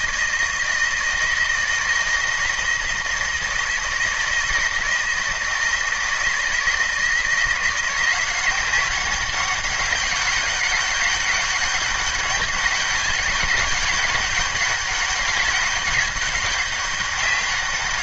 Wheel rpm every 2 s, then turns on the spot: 160, 160, 160, 160, 190, 200, 200, 200, 200.
none